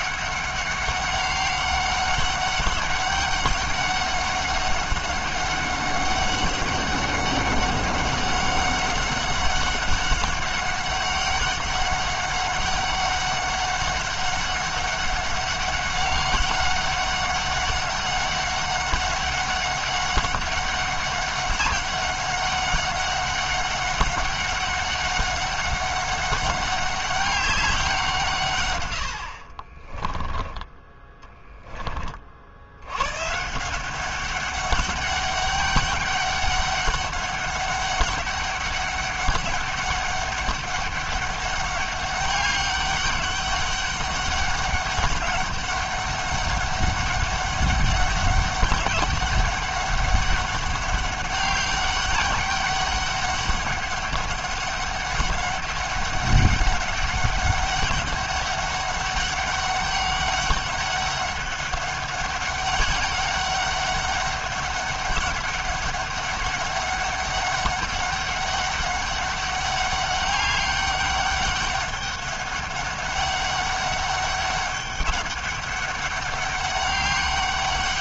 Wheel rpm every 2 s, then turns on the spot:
200, 200, 200, 200, 200, 200, 200, 200, 200, 200, 190, 200, 200, 200, 120, 10, 80, 200, 200, 200, 200, 200, 200, 200, 200, 190, 200, 200, 190, 200, 200, 200, 200, 200, 200, 200, 200, 200, 200.
none